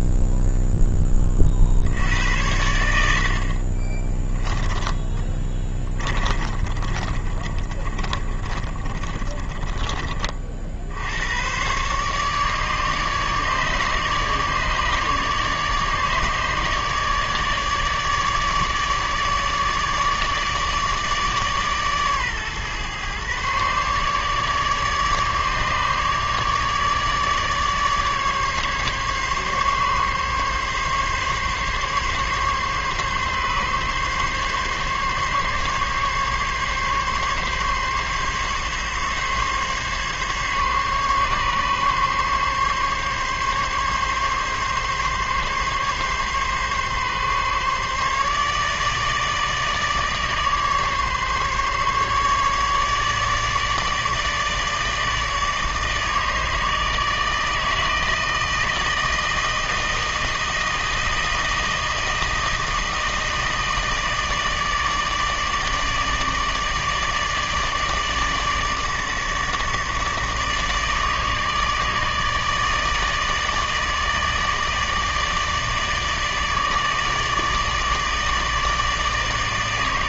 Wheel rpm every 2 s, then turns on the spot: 0, 90, 10, 30, 30, 60, 150, 150, 150, 150, 150, 130, 150, 150, 140, 140, 140, 140, 140, 140, 140, 140, 140, 140, 150, 150, 150, 150, 160, 160, 160, 160, 160, 160, 160, 150, 160, 160, 150, 150.
6-10